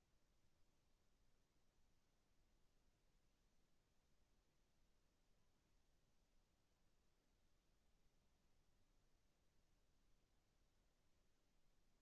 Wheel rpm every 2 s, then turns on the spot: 0, 0, 0, 0, 0, 0.
none